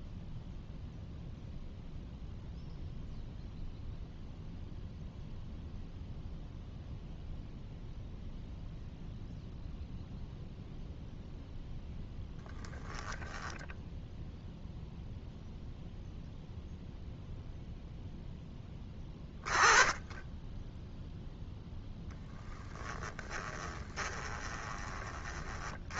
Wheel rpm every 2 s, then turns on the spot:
0, 0, 0, 0, 0, 0, 0, 0, 0, 10, 0, 10, 30.
22-26